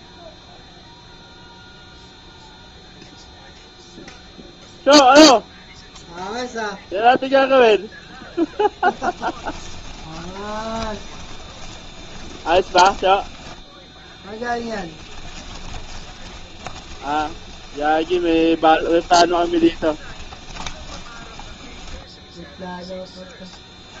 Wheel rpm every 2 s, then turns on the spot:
0, 0, 0, 0, 20, 20, 20, 10, 20, 30, 10, 0.
8-22